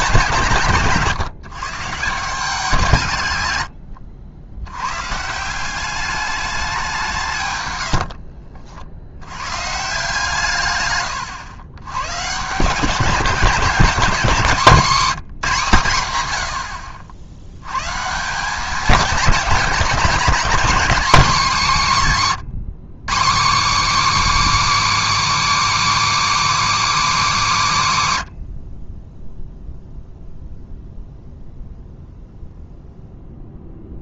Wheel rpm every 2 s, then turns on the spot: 160, 170, 100, 200, 60, 120, 160, 210, 70, 200, 240, 180, 310, 310, 80, 0, 0.
none